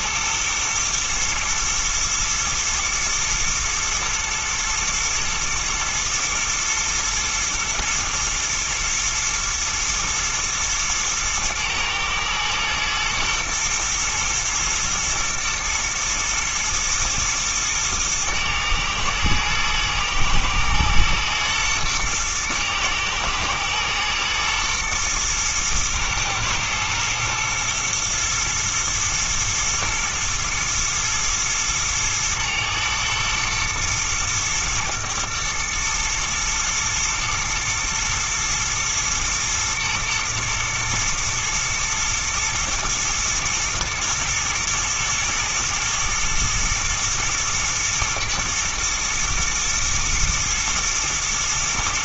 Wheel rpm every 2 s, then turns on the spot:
120, 110, 110, 120, 120, 110, 110, 110, 110, 110, 110, 110, 110, 120, 120, 120, 110, 110, 110, 110, 110, 110, 110, 110, 120, 110.
none